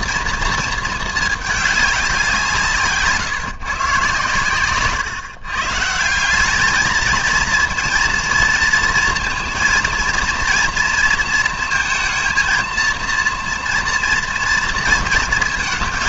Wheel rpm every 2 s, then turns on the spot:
230, 160, 130, 210, 220, 230, 230, 230.
none